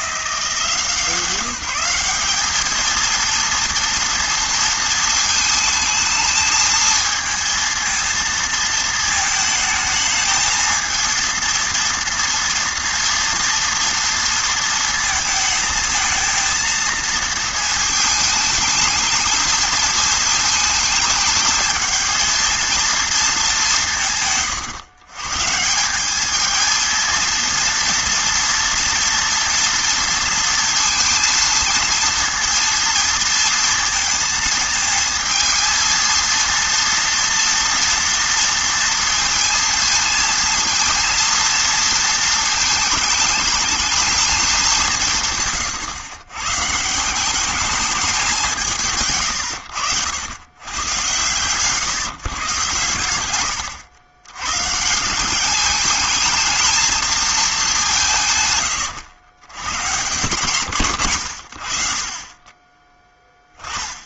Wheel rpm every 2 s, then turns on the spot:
180, 220, 230, 220, 230, 220, 230, 230, 230, 220, 220, 230, 120, 220, 230, 230, 230, 220, 230, 230, 230, 220, 180, 160, 160, 110, 110, 140, 220, 110, 120, 20.
52-54